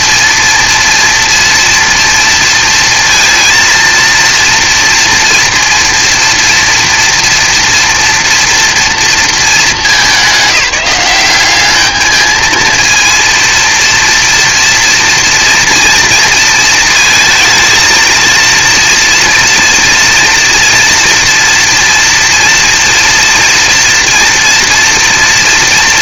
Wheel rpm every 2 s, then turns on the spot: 230, 230, 230, 230, 230, 200, 230, 230, 230, 240, 240, 230, 230.
none